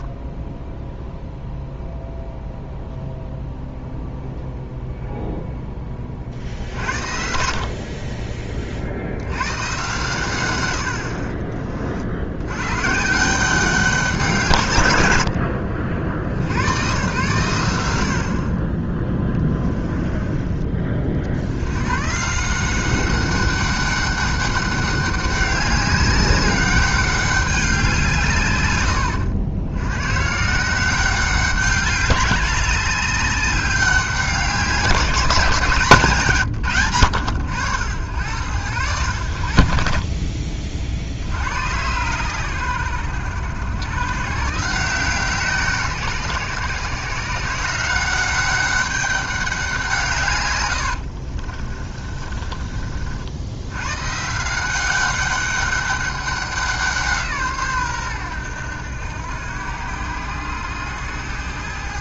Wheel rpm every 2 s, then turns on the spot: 0, 0, 0, 60, 50, 70, 130, 130, 100, 20, 40, 180, 200, 200, 110, 180, 200, 190, 110, 90, 50, 110, 150, 140, 200, 80, 40, 180, 180, 90, 100.
50-52